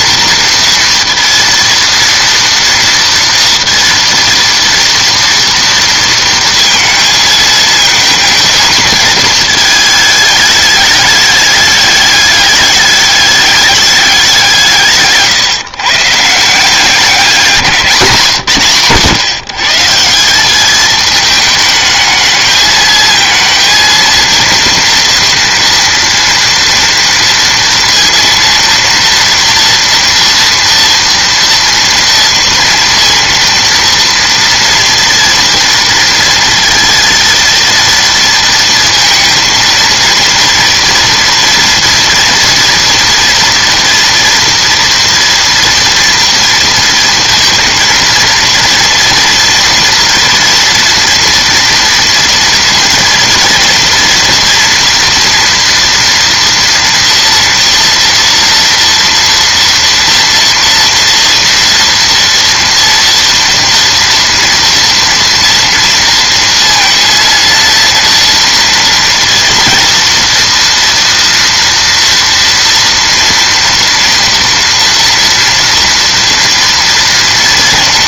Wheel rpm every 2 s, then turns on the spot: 230, 230, 230, 220, 220, 210, 210, 160, 180, 140, 210, 220, 230, 230, 230, 230, 230, 230, 230, 230, 230, 230, 230, 230, 230, 240, 230, 230, 230, 230, 230, 230, 230, 230, 230, 230, 230, 230, 240.
none